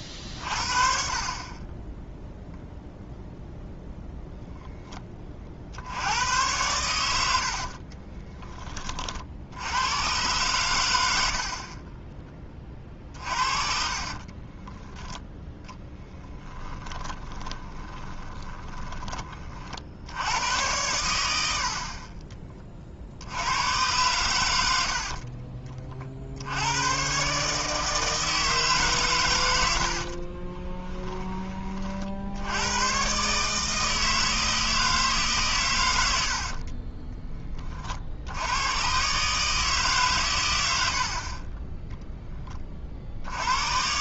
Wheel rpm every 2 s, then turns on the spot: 40, 0, 0, 100, 20, 110, 30, 30, 10, 20, 90, 30, 100, 80, 150, 20, 90, 160, 50, 100, 100, 30.
12-20 30-32 36-38